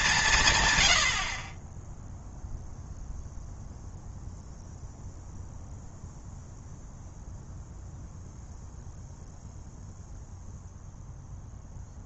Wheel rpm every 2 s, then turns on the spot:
150, 0, 0, 0, 0, 0.
none